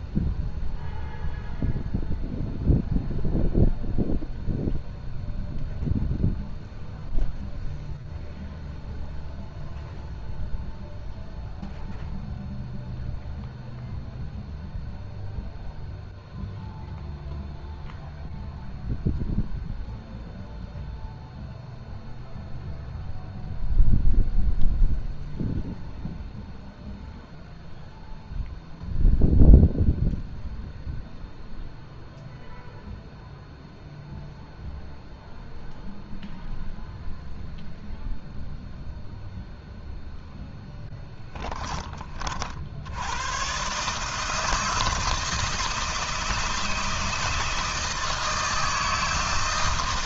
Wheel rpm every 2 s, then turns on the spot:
0, 0, 0, 0, 0, 0, 0, 0, 0, 0, 0, 0, 0, 0, 0, 0, 0, 0, 0, 0, 10, 80, 160, 160, 160.
40-42